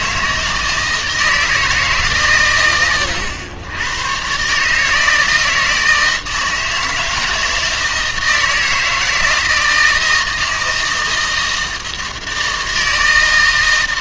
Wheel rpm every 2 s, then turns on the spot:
160, 110, 150, 160, 160, 160, 160.
none